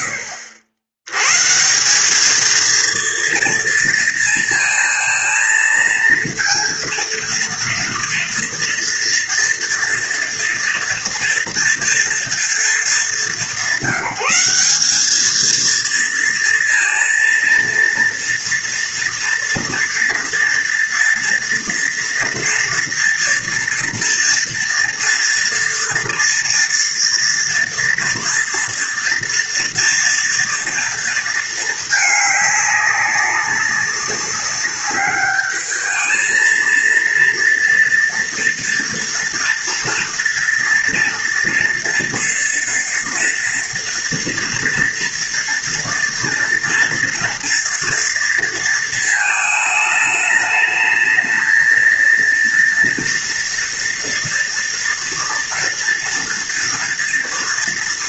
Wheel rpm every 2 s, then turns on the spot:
90, 230, 230, 230, 240, 230, 210, 210, 230, 240, 230, 230, 240, 230, 230, 230, 200, 210, 230, 230, 230, 230, 230, 230, 220, 220, 230, 230, 230.
none